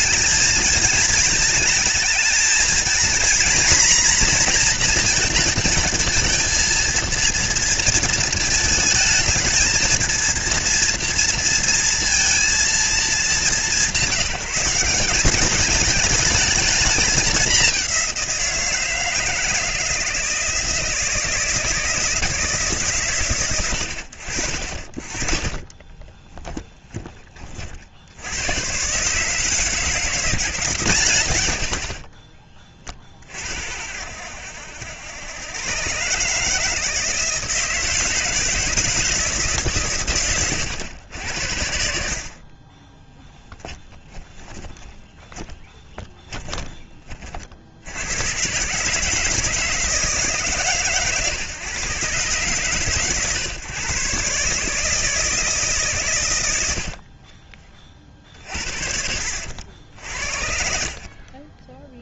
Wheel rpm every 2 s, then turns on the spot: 220, 230, 240, 230, 220, 230, 220, 180, 210, 170, 160, 140, 30, 20, 120, 150, 40, 90, 160, 160, 100, 20, 10, 30, 140, 140, 140, 150, 70, 60, 60.
42-46 56-60